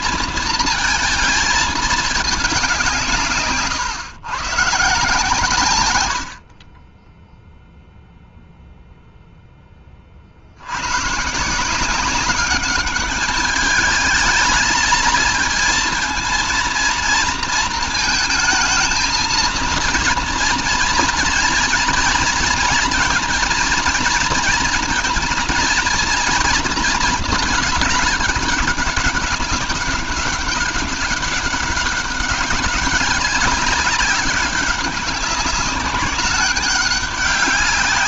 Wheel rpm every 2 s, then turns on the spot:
230, 190, 140, 30, 0, 90, 200, 220, 230, 230, 230, 240, 230, 230, 200, 200, 200, 200, 200.
none